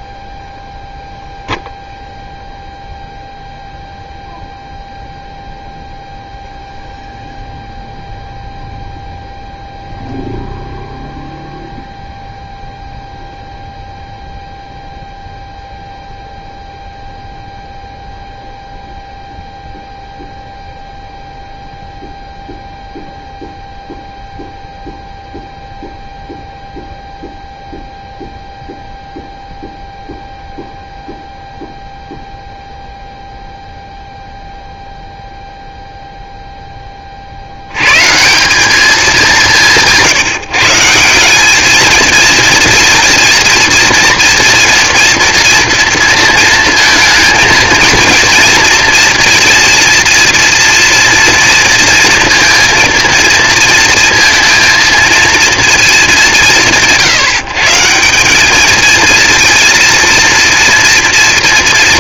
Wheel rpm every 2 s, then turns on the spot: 0, 0, 0, 0, 0, 0, 0, 0, 0, 0, 0, 0, 0, 0, 0, 0, 0, 0, 10, 200, 150, 230, 230, 230, 230, 240, 230, 230, 150, 210, 230.
none